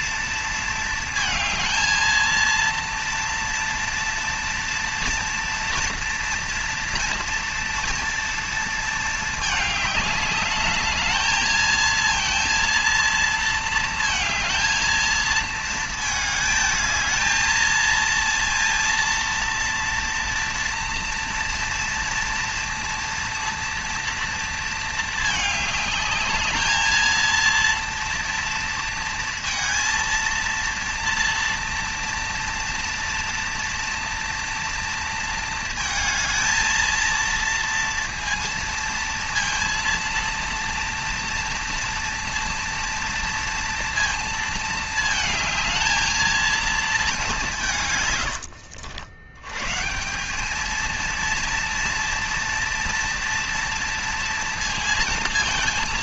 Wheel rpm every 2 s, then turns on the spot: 230, 230, 230, 230, 230, 210, 230, 230, 220, 230, 230, 230, 230, 210, 230, 230, 230, 230, 220, 230, 230, 230, 230, 220, 120, 180, 230, 230.
none